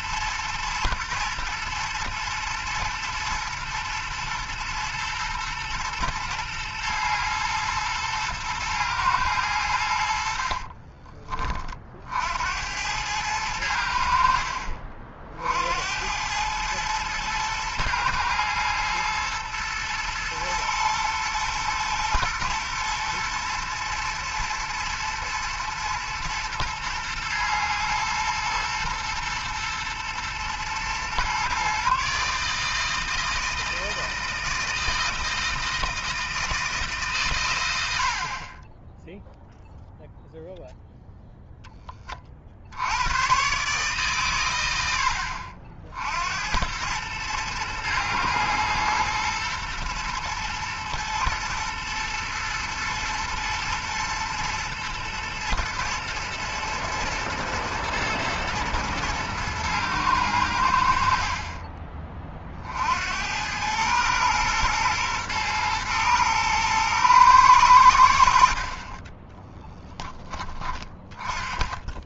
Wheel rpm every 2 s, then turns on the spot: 110, 120, 120, 110, 110, 40, 80, 50, 110, 110, 110, 120, 110, 110, 120, 120, 150, 160, 160, 30, 0, 60, 110, 90, 120, 110, 120, 120, 110, 120, 80, 50, 120, 110, 50, 20.
10-12